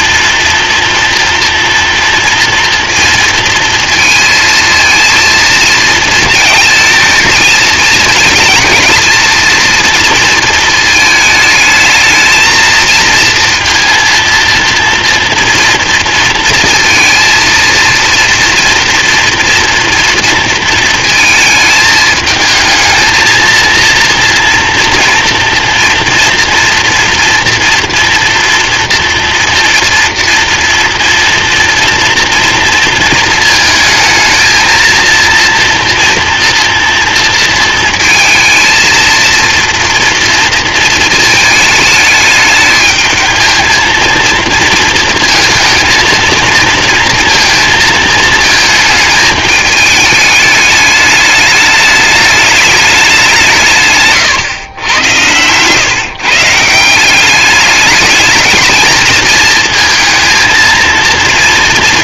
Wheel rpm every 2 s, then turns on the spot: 230, 230, 230, 220, 230, 220, 230, 230, 230, 230, 220, 220, 240, 230, 230, 240, 230, 230, 230, 230, 220, 220, 230, 230, 220, 210, 190, 100, 190, 220, 230.
none